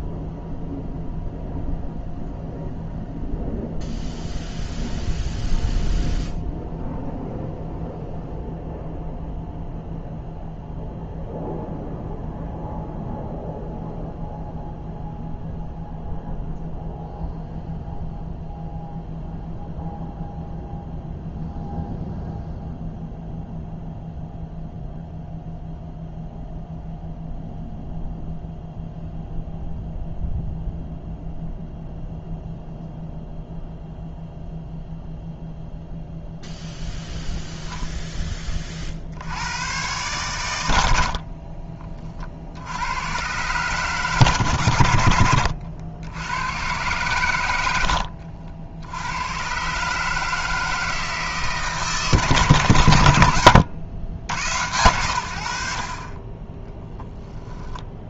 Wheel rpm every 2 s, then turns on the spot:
0, 0, 0, 0, 0, 0, 0, 0, 0, 0, 0, 0, 0, 0, 0, 0, 0, 0, 0, 40, 80, 90, 90, 120, 80, 160, 120, 100, 10.
none